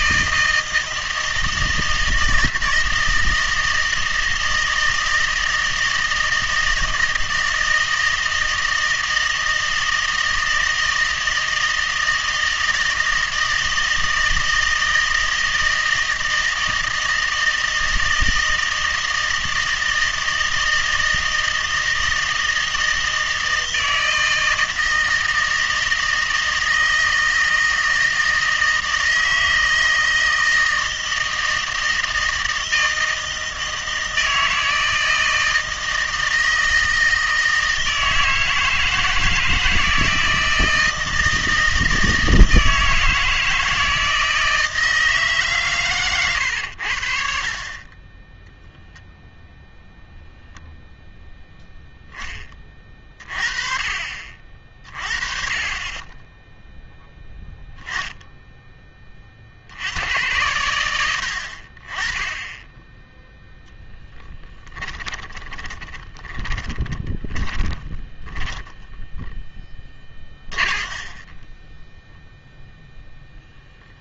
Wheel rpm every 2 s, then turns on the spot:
160, 160, 160, 160, 160, 160, 160, 160, 160, 160, 160, 160, 160, 160, 160, 160, 160, 160, 160, 160, 160, 160, 160, 100, 0, 0, 20, 50, 10, 10, 90, 10, 20, 20, 10, 30, 0.
64-72